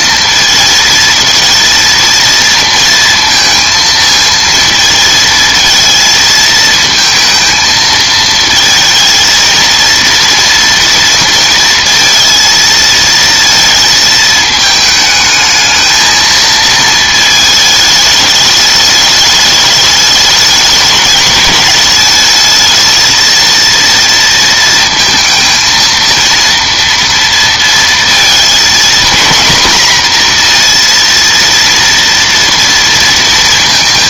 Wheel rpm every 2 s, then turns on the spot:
220, 230, 230, 220, 220, 230, 230, 220, 220, 210, 210, 220, 230, 230, 230, 240, 230.
none